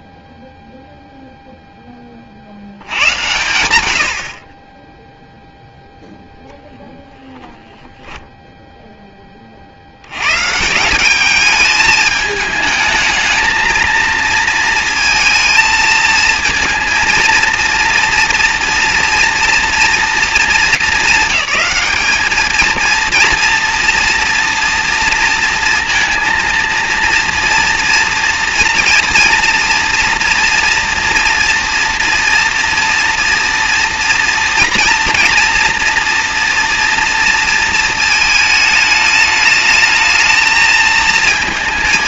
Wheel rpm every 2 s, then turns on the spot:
0, 100, 0, 20, 100, 210, 230, 220, 230, 230, 210, 230, 230, 230, 230, 230, 230, 240, 220, 220, 210.
none